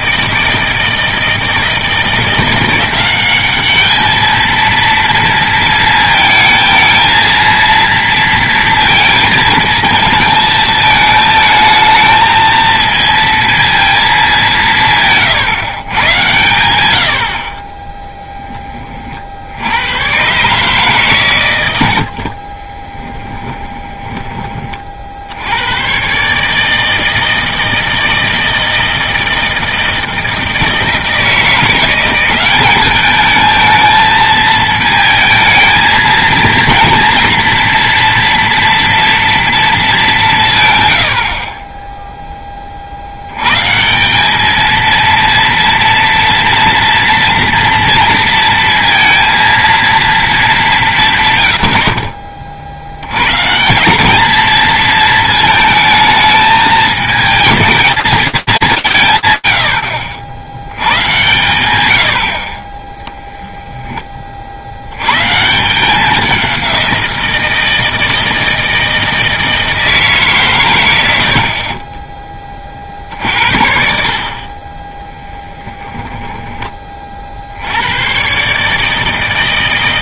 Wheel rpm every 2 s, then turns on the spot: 160, 180, 230, 220, 230, 220, 220, 170, 90, 20, 140, 40, 20, 150, 160, 160, 190, 220, 240, 230, 150, 30, 220, 230, 230, 190, 50, 230, 220, 230, 90, 70, 40, 190, 160, 140, 30, 30, 20, 150.
22-24